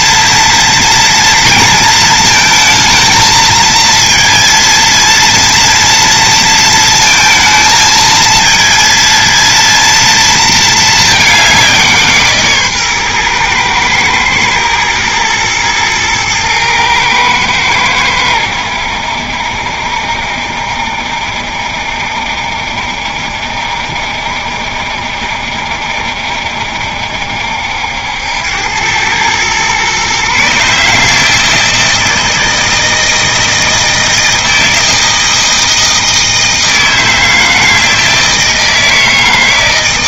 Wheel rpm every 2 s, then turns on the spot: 230, 220, 230, 230, 230, 230, 140, 110, 110, 90, 60, 70, 70, 70, 90, 150, 160, 160, 160, 160.
none